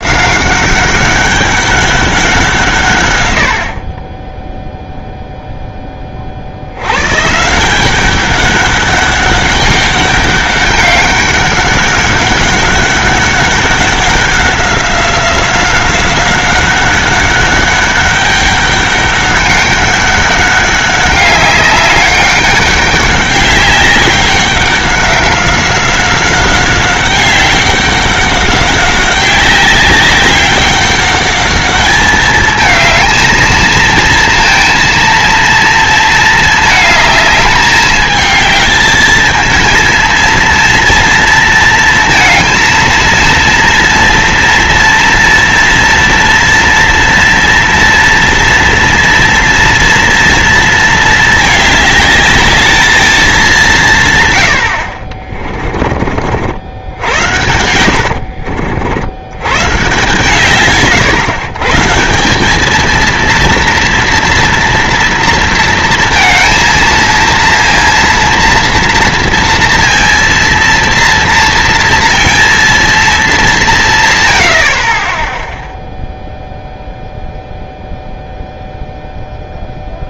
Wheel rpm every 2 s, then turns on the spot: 190, 150, 0, 100, 190, 200, 200, 190, 190, 200, 190, 200, 190, 190, 190, 200, 220, 230, 220, 220, 230, 230, 230, 230, 230, 230, 220, 80, 80, 80, 140, 210, 230, 230, 230, 230, 230, 50, 0, 0.
none